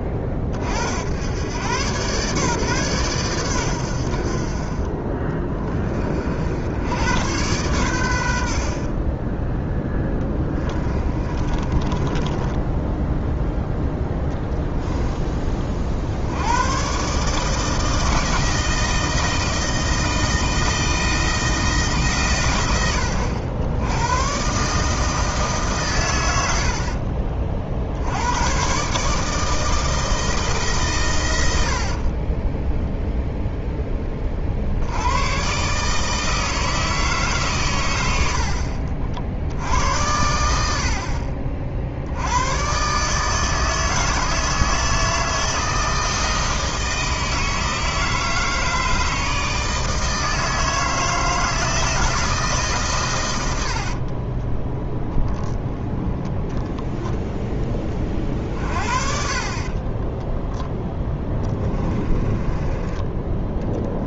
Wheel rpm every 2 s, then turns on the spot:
60, 130, 40, 80, 50, 20, 10, 20, 120, 160, 160, 90, 140, 60, 130, 140, 10, 50, 160, 60, 70, 130, 160, 160, 160, 160, 140, 10, 10, 50, 0, 20.
10-12 14-16 26-28